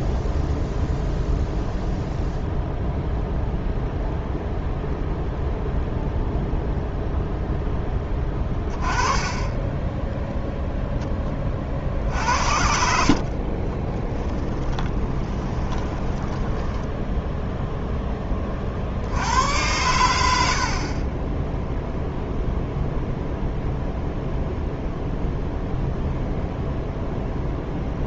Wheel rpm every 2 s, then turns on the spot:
0, 0, 0, 0, 30, 0, 60, 20, 10, 40, 50, 0, 0, 0.
12-18